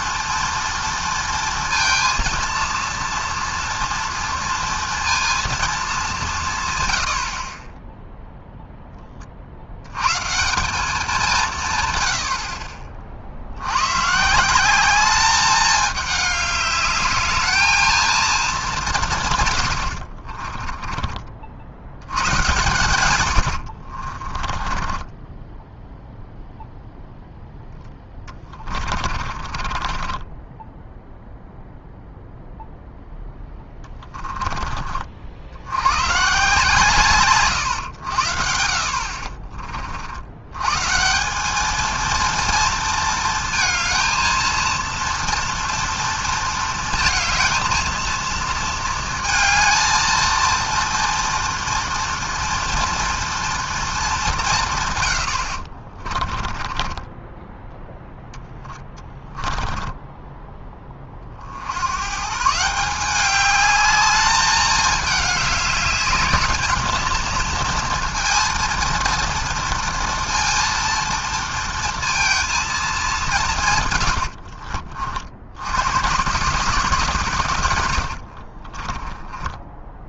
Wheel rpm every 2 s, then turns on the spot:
230, 230, 230, 60, 40, 180, 60, 210, 210, 140, 40, 90, 20, 0, 40, 0, 10, 60, 140, 50, 200, 220, 230, 230, 230, 230, 230, 90, 10, 10, 50, 200, 210, 230, 230, 230, 180, 70, 120, 30.
22-26 28-30 56-60